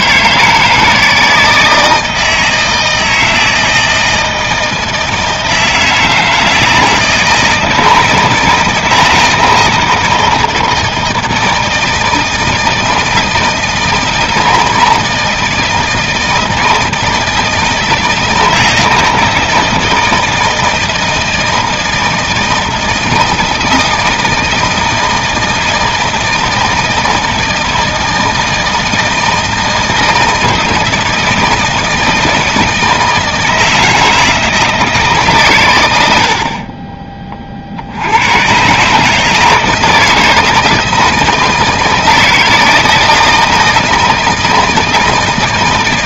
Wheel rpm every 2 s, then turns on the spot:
160, 160, 160, 160, 160, 160, 160, 160, 160, 160, 160, 160, 160, 160, 160, 160, 160, 160, 50, 120, 160, 160, 160.
none